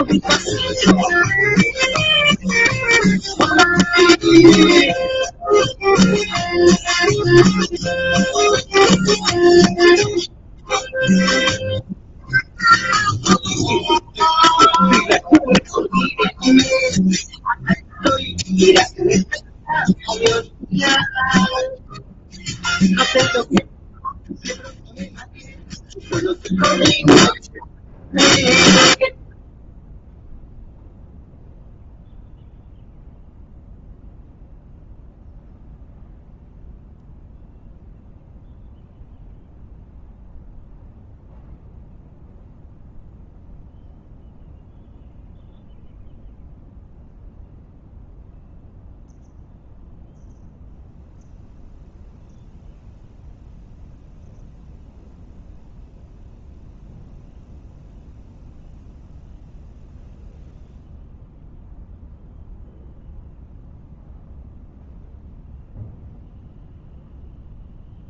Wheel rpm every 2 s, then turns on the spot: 0, 0, 0, 0, 0, 0, 0, 0, 0, 0, 0, 0, 0, 0, 0, 0, 0, 0, 0, 0, 0, 0, 0, 0, 0, 0, 0, 0, 0, 0, 0, 0, 0, 0.
none